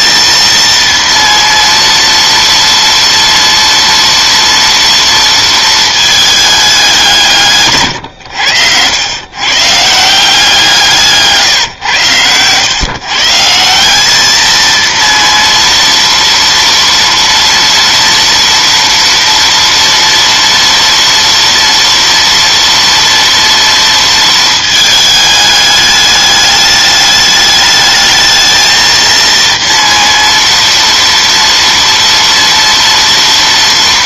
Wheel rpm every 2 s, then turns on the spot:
230, 230, 230, 200, 100, 170, 120, 230, 230, 230, 230, 230, 220, 210, 230, 230, 230.
none